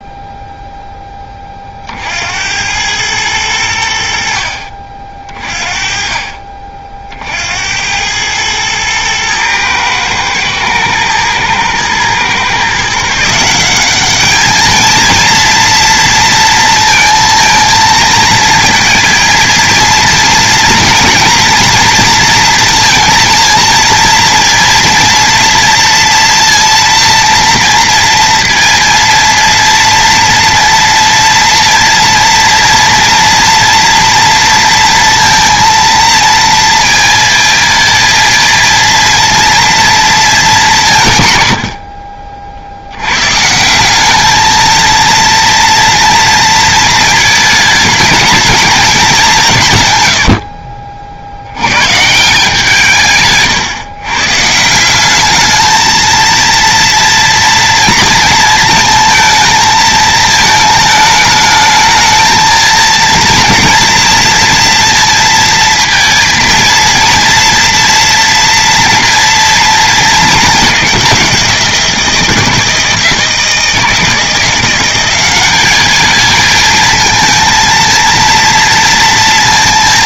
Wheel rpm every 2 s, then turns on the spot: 0, 100, 40, 40, 110, 110, 150, 230, 230, 230, 230, 230, 230, 230, 230, 230, 230, 230, 230, 230, 170, 80, 230, 230, 220, 60, 150, 180, 230, 220, 220, 230, 230, 230, 240, 200, 160, 180, 220, 230.
none